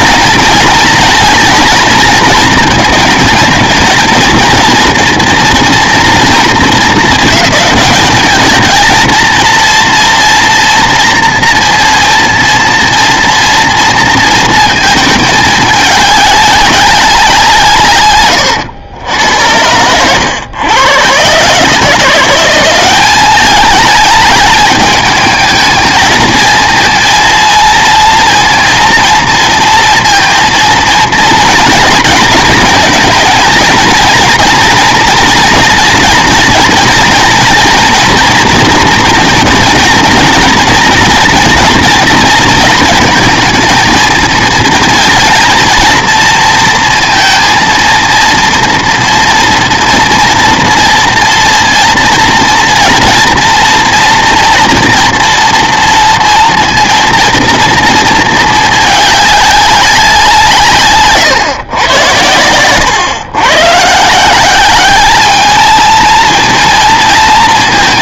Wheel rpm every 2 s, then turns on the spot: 230, 220, 230, 230, 220, 240, 240, 220, 200, 110, 110, 180, 210, 220, 230, 230, 230, 230, 230, 230, 230, 230, 230, 230, 230, 230, 240, 230, 230, 220, 150, 110, 190, 230.
none